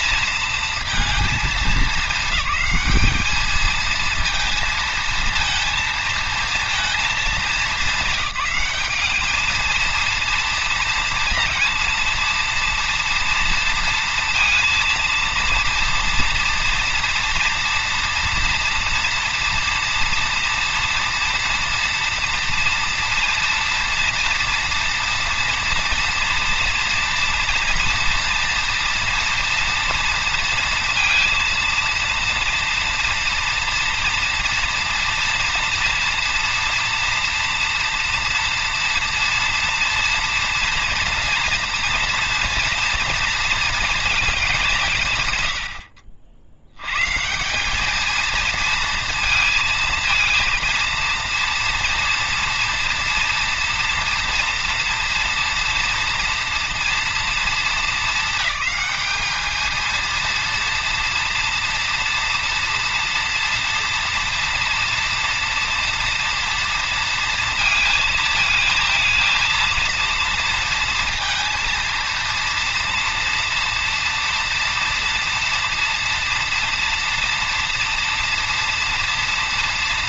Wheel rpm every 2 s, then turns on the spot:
230, 210, 230, 230, 190, 230, 230, 230, 230, 230, 230, 240, 230, 230, 230, 230, 230, 230, 230, 230, 230, 230, 170, 110, 230, 230, 230, 240, 240, 220, 220, 230, 230, 220, 220, 230, 230, 230, 230, 240.
none